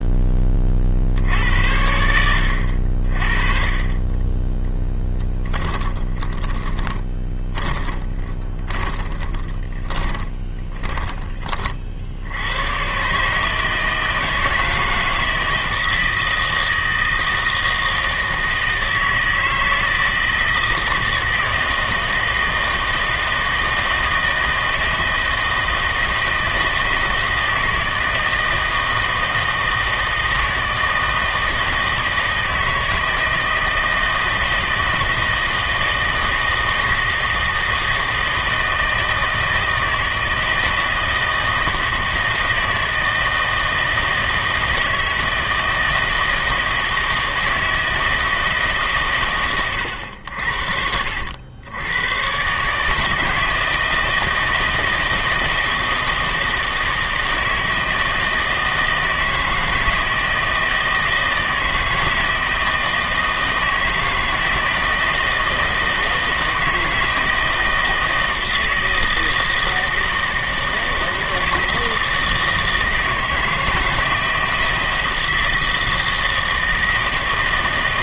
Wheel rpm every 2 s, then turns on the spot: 30, 70, 10, 20, 20, 20, 100, 160, 160, 160, 160, 160, 160, 160, 160, 160, 160, 160, 160, 160, 160, 160, 160, 160, 150, 60, 150, 160, 160, 160, 160, 160, 160, 160, 160, 160, 160, 160, 160.
6-12